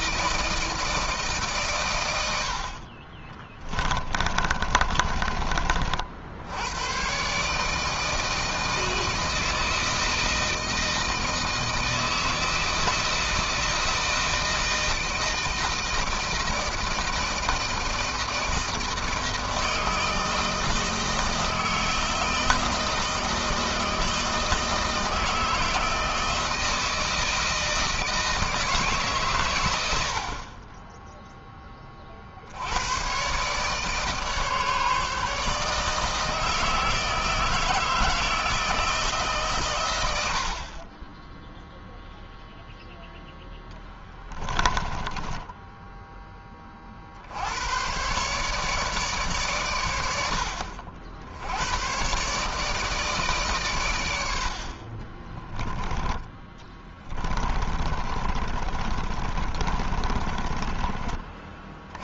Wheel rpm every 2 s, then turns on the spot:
160, 70, 30, 80, 160, 160, 160, 160, 160, 160, 160, 160, 160, 160, 160, 30, 70, 150, 160, 160, 60, 0, 10, 30, 150, 70, 150, 40, 20, 30, 30.
4-6 30-32 44-46 56-60